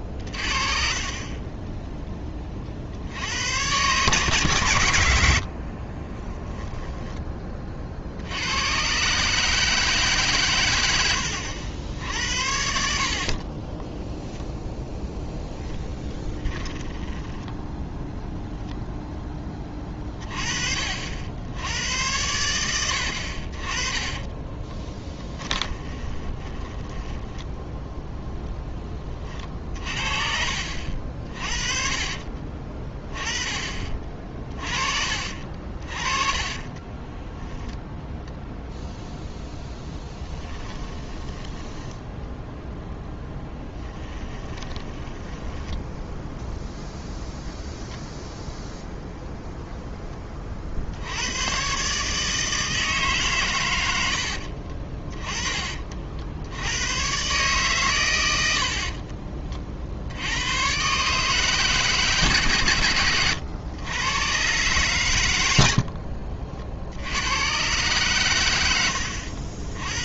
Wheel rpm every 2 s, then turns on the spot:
40, 40, 110, 10, 110, 110, 70, 10, 20, 0, 40, 90, 20, 20, 10, 50, 30, 40, 20, 0, 10, 0, 20, 0, 0, 50, 160, 50, 100, 60, 120, 110, 120, 70, 80.
0-2 14-18 24-28 32-34 36-38 40-42 44-46 58-60